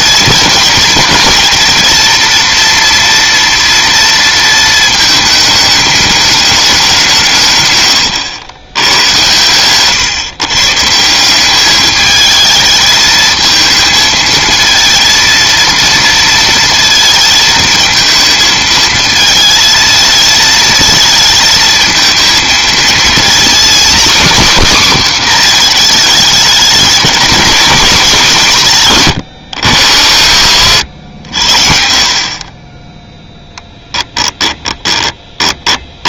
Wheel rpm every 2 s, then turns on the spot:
230, 230, 220, 200, 110, 150, 220, 230, 230, 220, 220, 220, 260, 210, 180, 80, 20, 20.
30-32 34-36